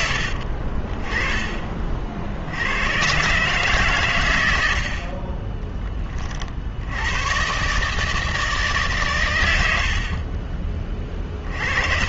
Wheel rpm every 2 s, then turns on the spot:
50, 80, 90, 50, 160, 30.
none